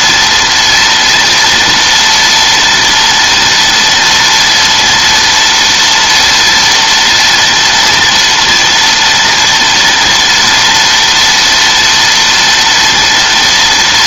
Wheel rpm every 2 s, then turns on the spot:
230, 230, 230, 230, 240, 230, 230.
none